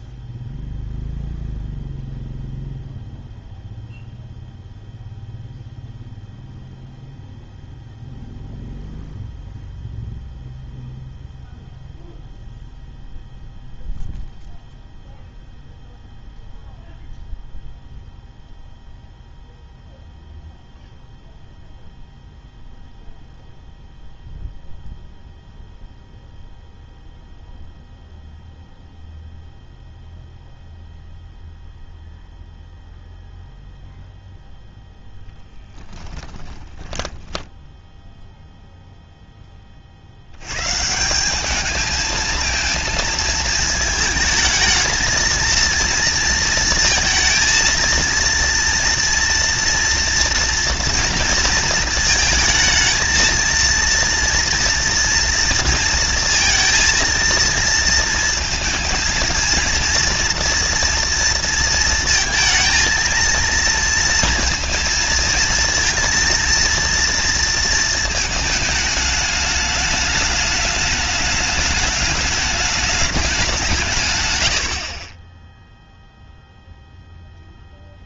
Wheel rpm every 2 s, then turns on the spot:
0, 0, 0, 0, 0, 0, 0, 0, 0, 0, 0, 0, 0, 0, 0, 0, 0, 0, 10, 0, 80, 220, 220, 230, 230, 230, 220, 230, 230, 220, 230, 220, 230, 230, 220, 210, 210, 120, 0.
36-38